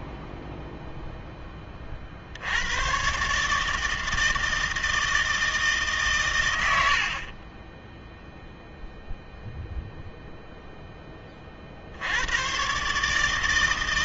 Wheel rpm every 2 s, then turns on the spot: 10, 100, 160, 110, 0, 0, 130.
0-2